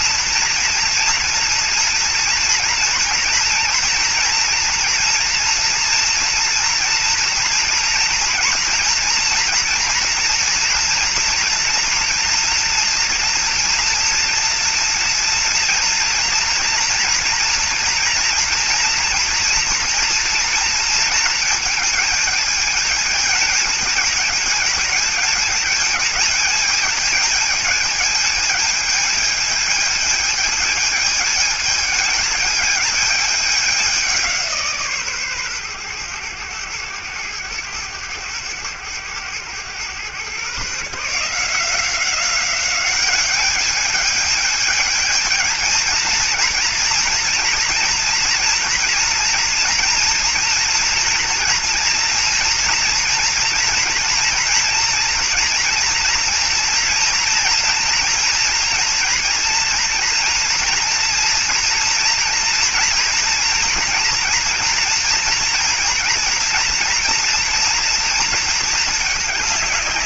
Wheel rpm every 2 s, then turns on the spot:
240, 230, 230, 230, 230, 230, 230, 230, 230, 240, 230, 220, 220, 220, 220, 220, 220, 150, 110, 100, 140, 200, 220, 230, 240, 230, 230, 240, 240, 240, 230, 240, 230, 230, 220.
none